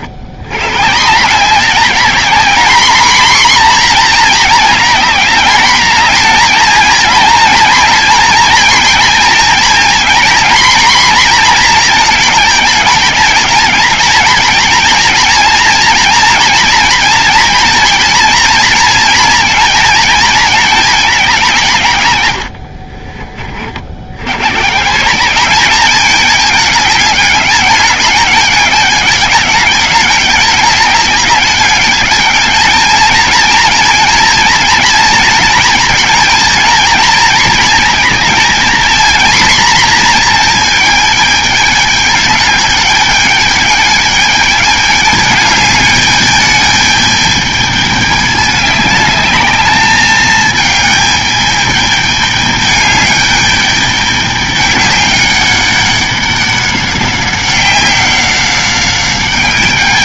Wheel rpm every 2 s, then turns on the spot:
110, 220, 230, 230, 230, 240, 220, 230, 240, 230, 220, 80, 120, 210, 210, 210, 220, 230, 220, 230, 230, 210, 210, 210, 210, 210, 210, 210, 190, 190.
22-24